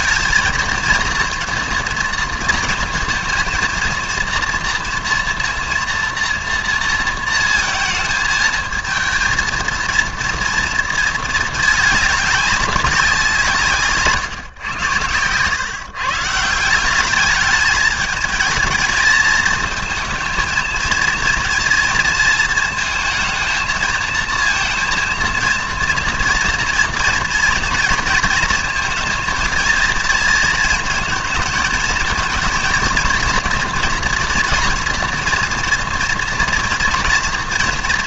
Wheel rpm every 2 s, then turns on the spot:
220, 230, 240, 230, 220, 230, 200, 120, 180, 220, 230, 220, 230, 230, 220, 230, 230, 230, 230.
none